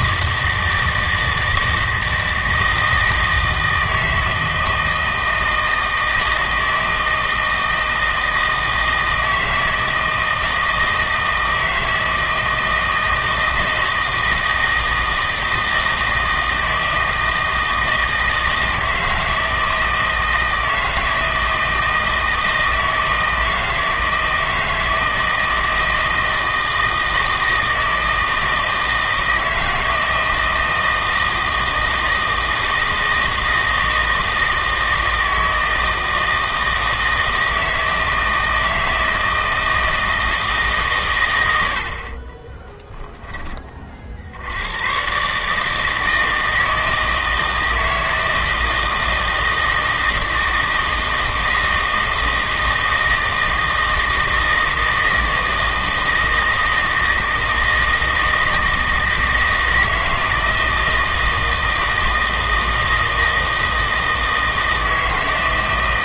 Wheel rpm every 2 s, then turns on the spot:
160, 160, 160, 160, 160, 160, 160, 160, 160, 160, 160, 160, 160, 160, 160, 160, 160, 160, 160, 160, 150, 20, 100, 160, 160, 160, 160, 160, 160, 160, 160, 160, 160.
42-44